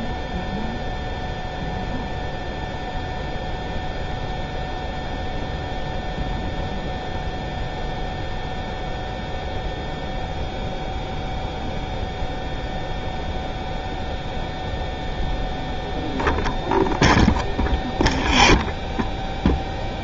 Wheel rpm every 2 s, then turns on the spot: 0, 0, 0, 0, 0, 0, 0, 0, 0, 0.
none